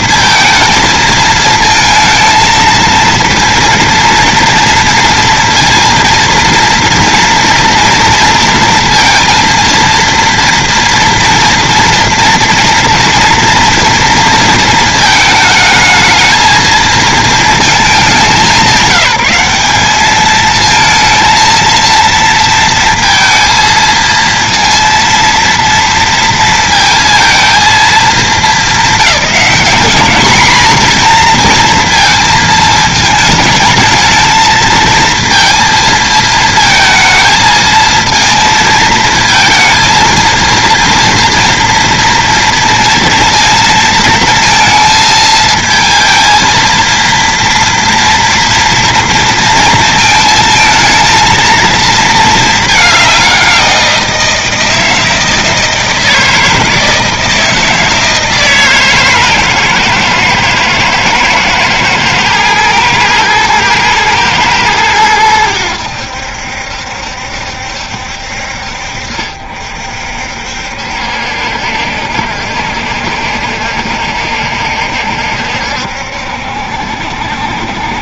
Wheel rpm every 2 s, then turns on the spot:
220, 220, 230, 230, 230, 230, 230, 220, 220, 180, 220, 230, 230, 220, 210, 230, 220, 230, 220, 220, 230, 230, 220, 230, 230, 220, 210, 160, 160, 150, 110, 110, 110, 70, 60, 60, 70, 70, 70.
none